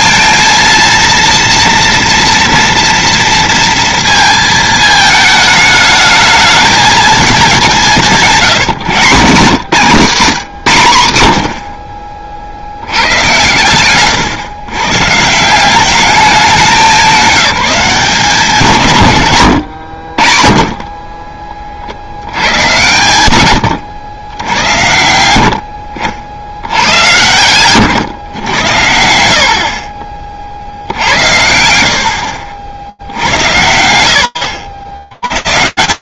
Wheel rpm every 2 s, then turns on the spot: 230, 240, 220, 220, 160, 120, 70, 120, 210, 160, 30, 110, 90, 100, 100, 60, 70, 80.
none